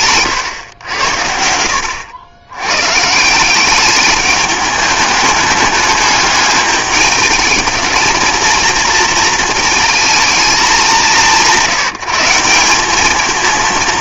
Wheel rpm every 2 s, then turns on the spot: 100, 110, 210, 210, 230, 200, 190.
none